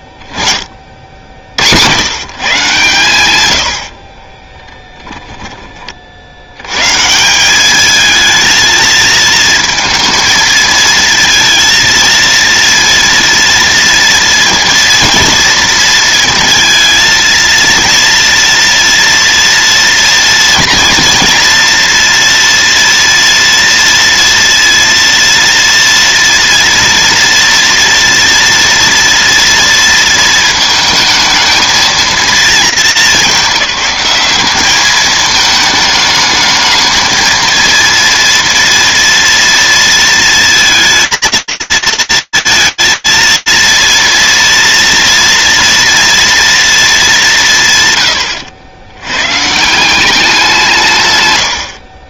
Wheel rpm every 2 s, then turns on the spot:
20, 130, 10, 90, 220, 230, 230, 230, 230, 230, 230, 230, 230, 230, 230, 220, 220, 210, 220, 230, 220, 230, 230, 230, 100, 180.
4-6 48-50